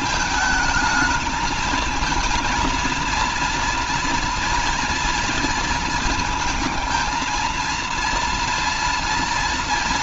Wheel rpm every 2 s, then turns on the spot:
220, 230, 230, 220, 230.
none